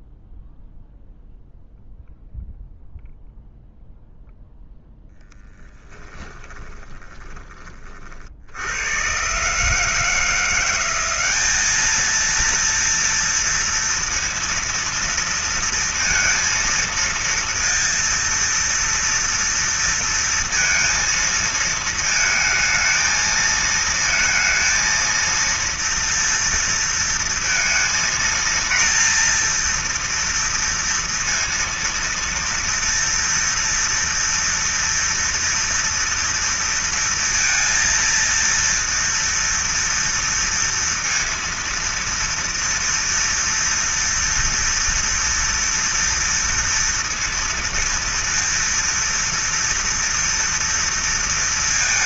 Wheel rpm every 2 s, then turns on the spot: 0, 0, 0, 10, 60, 160, 230, 230, 230, 230, 230, 220, 230, 230, 230, 240, 230, 230, 230, 230, 230, 230, 230, 230, 230, 230.
6-8